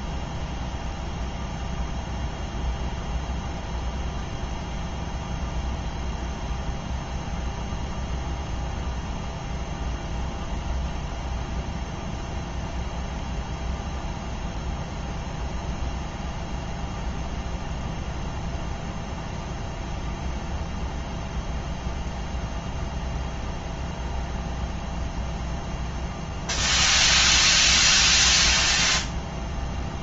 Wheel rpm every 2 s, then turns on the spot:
0, 0, 0, 0, 0, 0, 0, 0, 0, 0, 0, 0, 0, 0, 0.
none